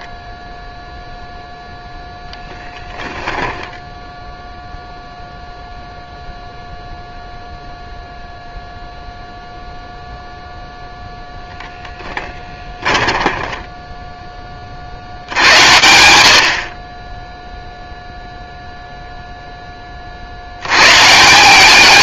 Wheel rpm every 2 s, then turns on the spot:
10, 10, 0, 0, 0, 0, 10, 100, 0, 0, 150.
2-4 12-14